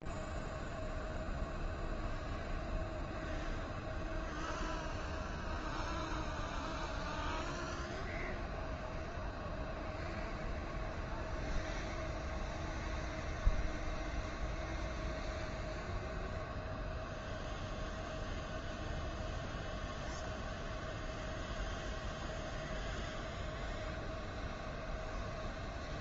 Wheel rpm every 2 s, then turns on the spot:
0, 0, 0, 0, 0, 0, 0, 0, 0, 0, 0, 0, 0.
none